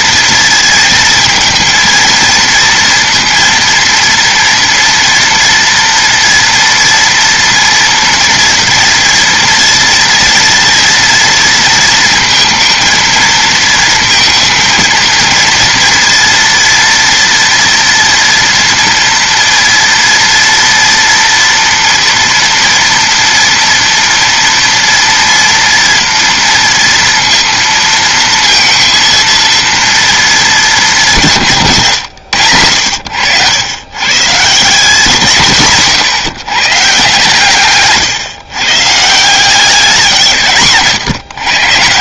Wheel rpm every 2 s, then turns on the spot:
230, 230, 230, 230, 230, 230, 230, 230, 230, 230, 230, 230, 230, 230, 230, 180, 100, 180, 150, 150, 140.
none